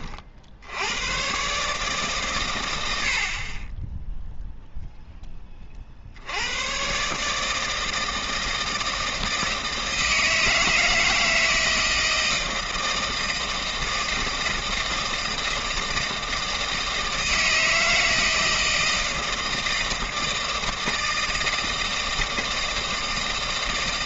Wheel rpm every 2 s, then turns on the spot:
80, 100, 0, 120, 160, 160, 160, 160, 160, 160, 160, 160.
none